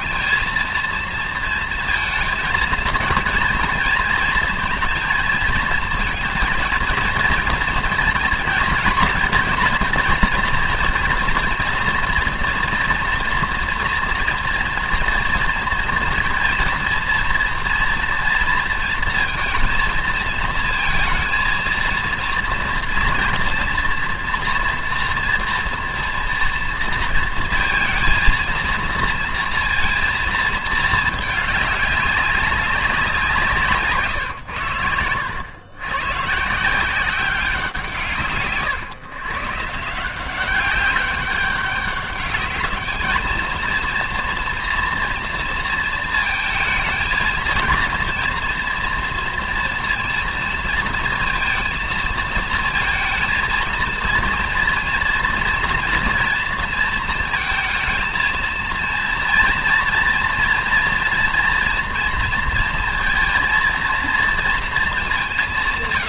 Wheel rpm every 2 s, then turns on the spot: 230, 230, 230, 230, 230, 230, 230, 230, 230, 230, 220, 230, 230, 230, 230, 220, 180, 90, 170, 130, 190, 220, 230, 230, 230, 230, 230, 230, 220, 230, 230, 230, 210.
none